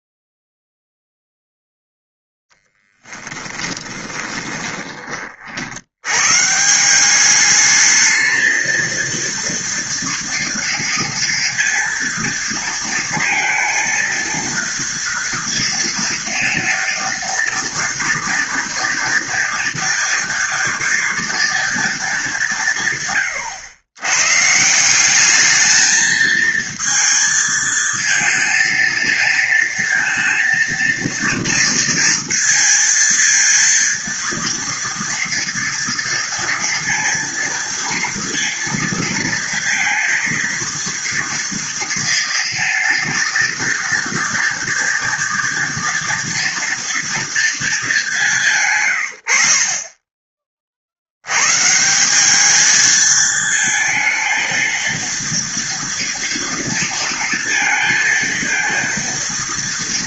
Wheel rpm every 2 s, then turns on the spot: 0, 10, 20, 150, 220, 230, 230, 230, 230, 240, 240, 180, 140, 220, 220, 230, 230, 230, 230, 230, 230, 230, 230, 230, 160, 30, 210, 230, 230, 230.
4-6